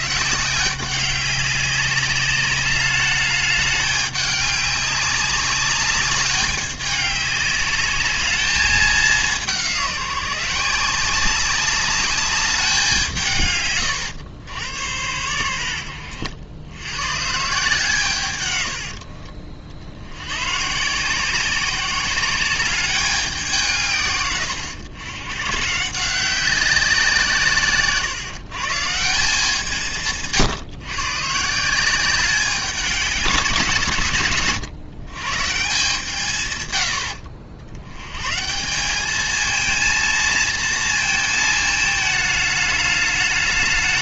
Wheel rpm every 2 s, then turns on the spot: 190, 200, 200, 200, 210, 170, 200, 100, 90, 100, 130, 190, 110, 180, 140, 140, 190, 130, 120, 170, 230, 210.
18-20